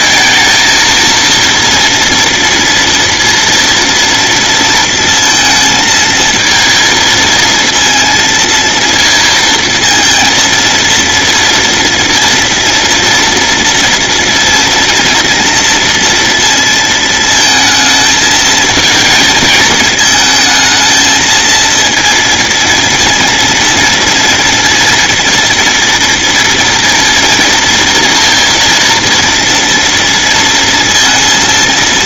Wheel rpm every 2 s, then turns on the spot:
230, 230, 230, 230, 230, 230, 230, 230, 220, 220, 220, 230, 230, 230, 230, 230.
none